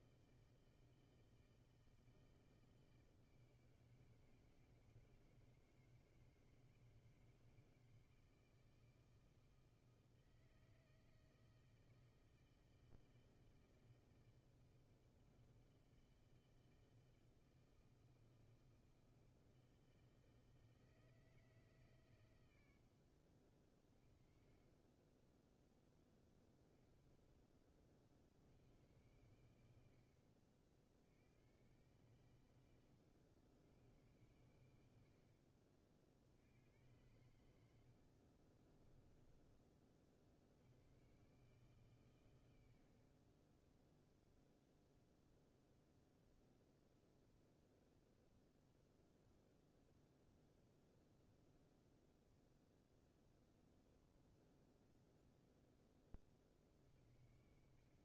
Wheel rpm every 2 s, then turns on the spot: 160, 160, 160, 160, 160, 160, 160, 160, 160, 160, 160, 100, 20, 40, 80, 70, 90, 90, 70, 40, 70, 90, 0, 0, 0, 0, 0, 0, 50.
38-40